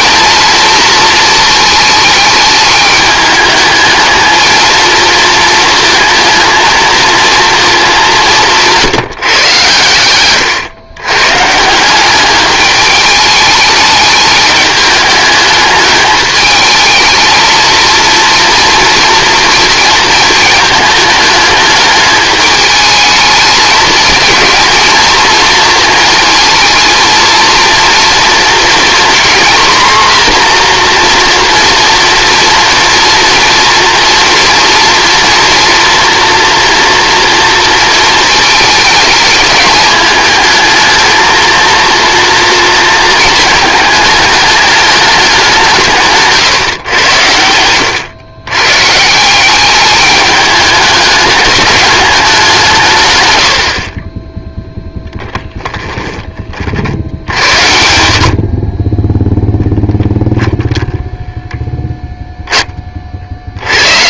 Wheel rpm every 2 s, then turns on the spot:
220, 210, 220, 230, 170, 130, 210, 210, 220, 230, 220, 210, 220, 230, 230, 240, 230, 230, 230, 220, 220, 230, 210, 120, 120, 210, 170, 0, 50, 40, 10, 20.
none